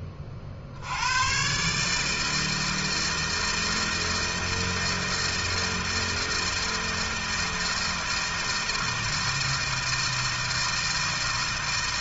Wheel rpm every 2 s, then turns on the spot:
100, 160, 160, 160, 160, 160.
none